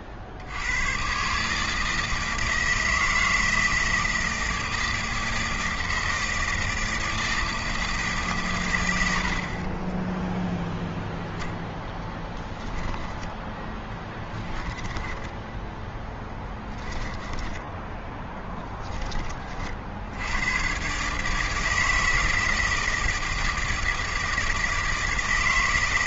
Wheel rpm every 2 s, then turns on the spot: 100, 160, 160, 160, 130, 0, 10, 20, 10, 10, 110, 160, 160.
16-18